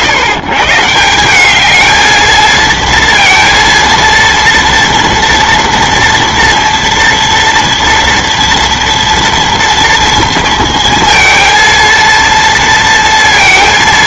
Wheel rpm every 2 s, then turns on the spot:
140, 230, 240, 230, 230, 230, 230.
none